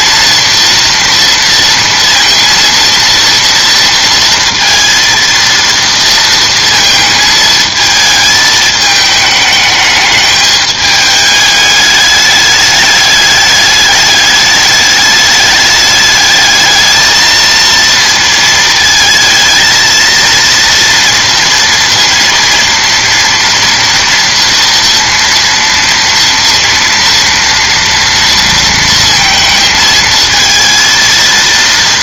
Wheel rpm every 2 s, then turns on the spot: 230, 230, 230, 220, 220, 210, 210, 210, 220, 220, 230, 230, 230, 230, 230, 220.
none